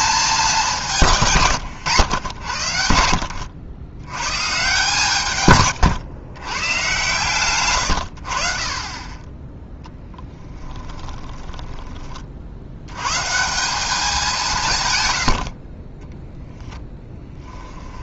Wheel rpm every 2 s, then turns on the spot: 190, 90, 140, 120, 40, 10, 90, 160, 0.
10-12